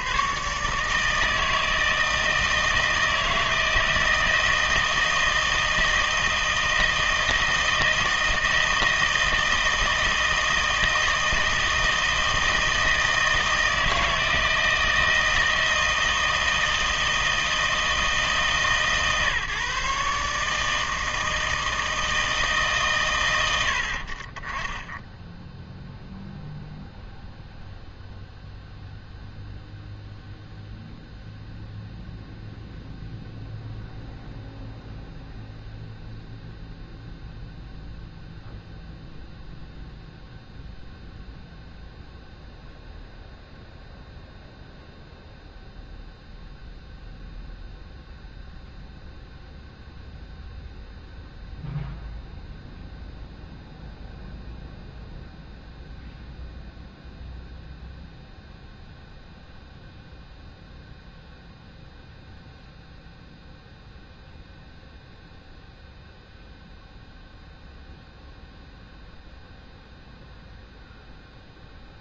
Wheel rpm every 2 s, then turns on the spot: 140, 160, 160, 160, 160, 160, 160, 160, 160, 150, 150, 150, 20, 0, 0, 0, 0, 0, 0, 0, 0, 0, 0, 0, 0, 0, 0, 0, 0, 0, 0, 0, 0, 0, 0, 0.
none